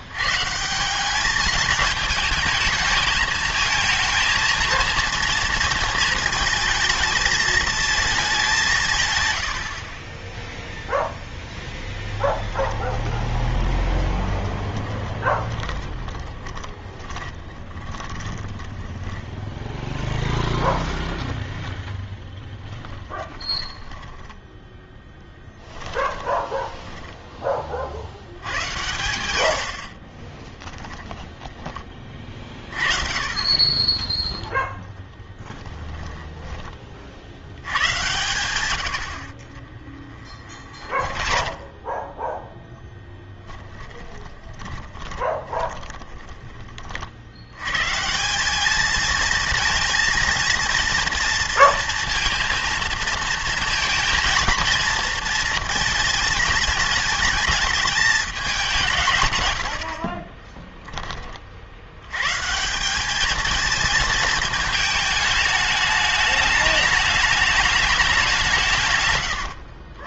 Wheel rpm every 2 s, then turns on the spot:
160, 220, 230, 220, 170, 0, 20, 30, 20, 20, 0, 20, 10, 20, 100, 20, 40, 10, 20, 100, 40, 0, 10, 30, 200, 230, 230, 230, 220, 190, 10, 170, 220, 210, 170.
12-20 22-28 30-32 40-42 44-46 60-62